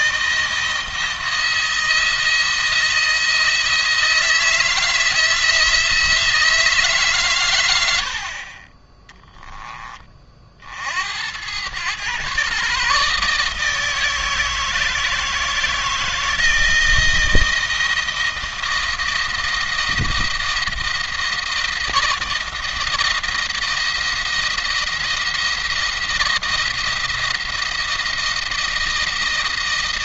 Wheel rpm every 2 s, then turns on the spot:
170, 160, 160, 150, 30, 70, 140, 160, 160, 160, 160, 160, 170, 170, 160.
8-10